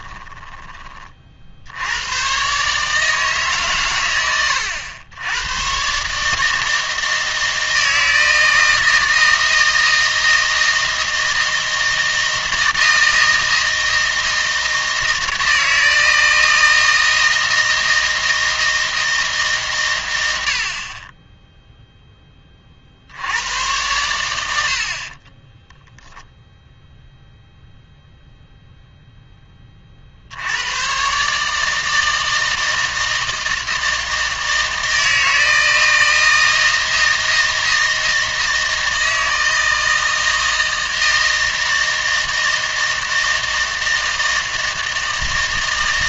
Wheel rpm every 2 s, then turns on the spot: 10, 140, 100, 160, 160, 160, 160, 160, 160, 160, 70, 30, 70, 0, 0, 90, 160, 160, 160, 160, 160, 160, 160.
none